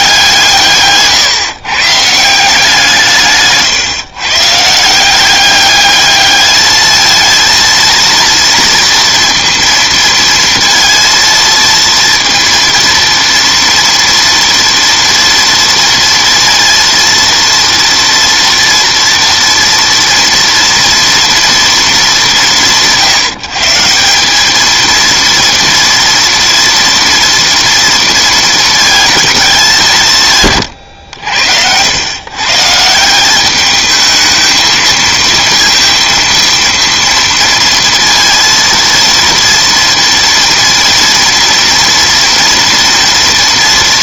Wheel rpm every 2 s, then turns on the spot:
140, 170, 150, 220, 230, 230, 230, 230, 230, 230, 230, 170, 220, 240, 230, 130, 150, 220, 230, 230, 230, 230.
none